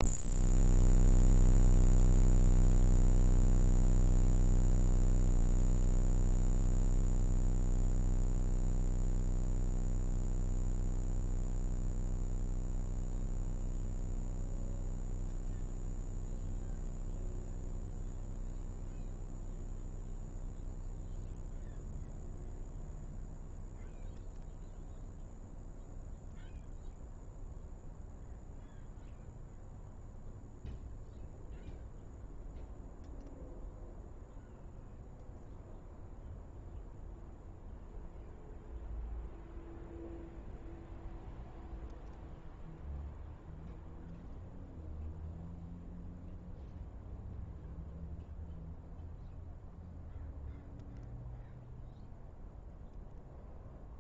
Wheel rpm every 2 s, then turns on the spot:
0, 0, 0, 0, 0, 0, 0, 0, 0, 0, 0, 0, 0, 0, 0, 0, 0, 0, 0, 0, 0, 0, 0, 0, 0, 0, 0.
none